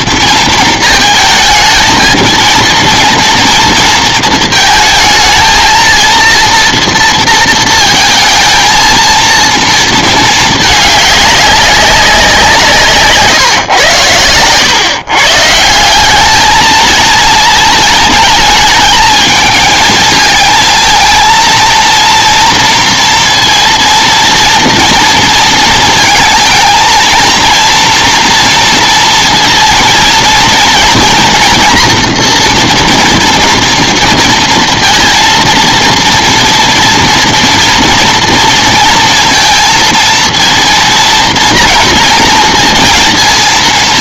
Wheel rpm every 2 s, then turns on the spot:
220, 230, 220, 230, 230, 200, 140, 150, 220, 220, 230, 230, 230, 230, 230, 230, 240, 230, 230, 230, 230, 230.
none